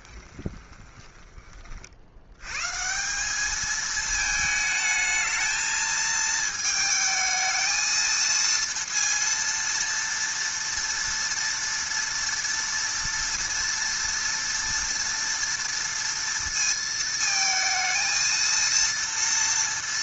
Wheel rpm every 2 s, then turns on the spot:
20, 130, 220, 220, 230, 230, 230, 230, 230, 230.
0-2